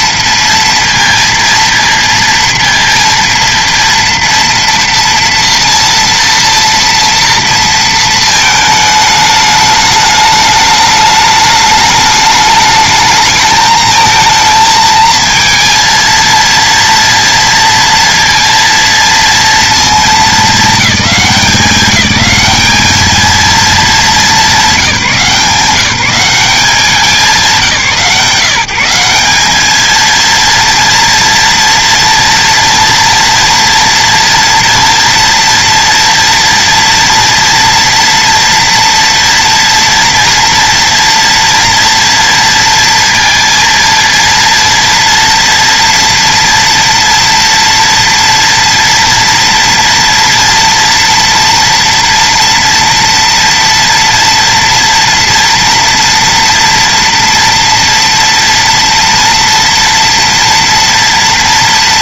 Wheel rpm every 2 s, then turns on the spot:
230, 230, 230, 230, 220, 210, 210, 220, 230, 230, 220, 200, 210, 180, 160, 220, 230, 230, 230, 240, 230, 230, 230, 230, 230, 230, 230, 230, 230, 230, 230.
none